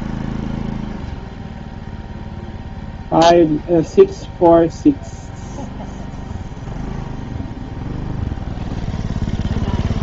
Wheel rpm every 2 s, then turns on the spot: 0, 0, 0, 0, 0.
none